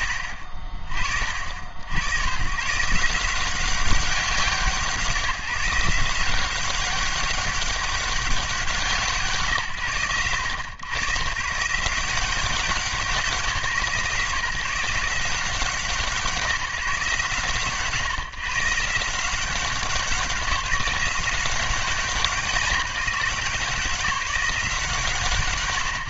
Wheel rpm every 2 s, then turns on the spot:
40, 150, 160, 200, 150, 130, 170, 160, 140, 160, 180, 170, 160.
none